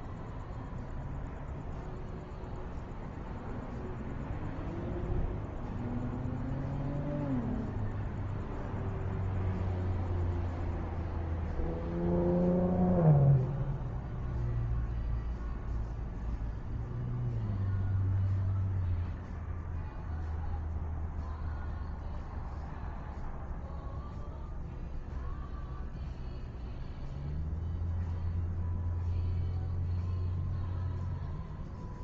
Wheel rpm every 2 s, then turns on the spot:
0, 0, 0, 0, 0, 0, 0, 0, 0, 0, 0, 0, 0, 0, 0, 0.
none